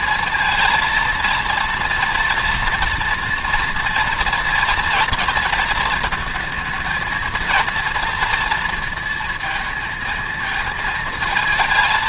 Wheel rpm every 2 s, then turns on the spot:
230, 230, 230, 220, 230, 220.
none